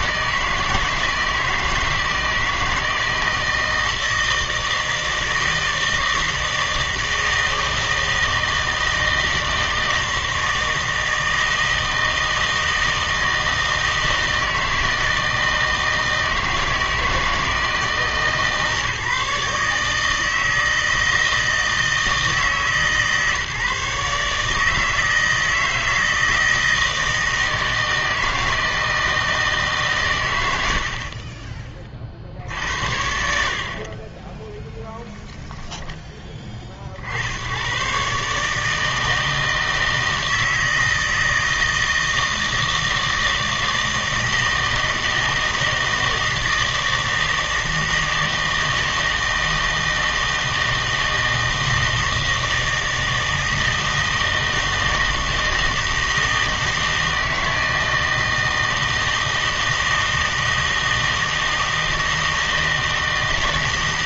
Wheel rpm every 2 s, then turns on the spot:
160, 160, 160, 160, 160, 160, 160, 160, 160, 150, 160, 150, 150, 160, 160, 100, 70, 10, 40, 150, 160, 160, 160, 160, 160, 160, 160, 160, 160, 160, 160, 160.
none